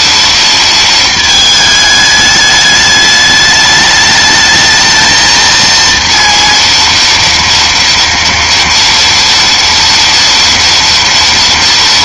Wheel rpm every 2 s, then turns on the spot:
230, 210, 220, 230, 230, 230.
none